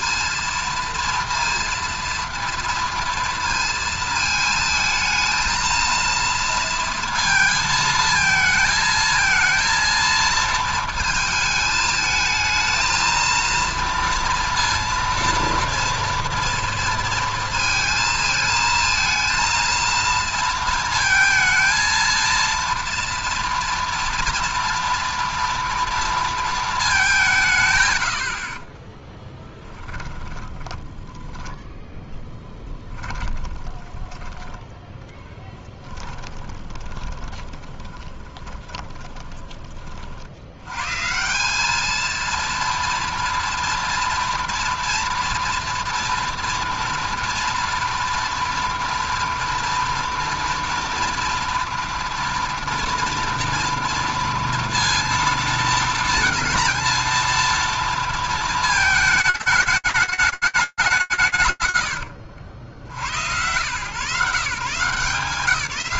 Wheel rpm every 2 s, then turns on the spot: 230, 230, 220, 230, 220, 220, 220, 230, 230, 220, 230, 230, 230, 210, 10, 10, 10, 10, 20, 10, 120, 230, 230, 230, 230, 230, 230, 230, 230, 220, 110, 130, 170.
28-34 36-40 60-62